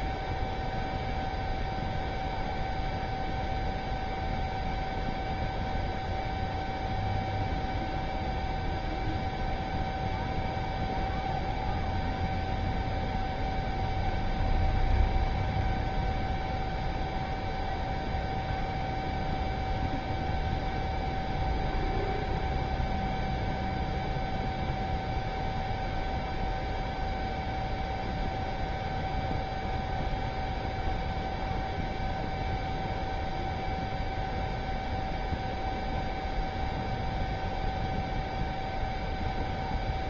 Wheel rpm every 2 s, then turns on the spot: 0, 0, 0, 0, 0, 0, 0, 0, 0, 0, 0, 0, 0, 0, 0, 0, 0, 0, 0, 0.
none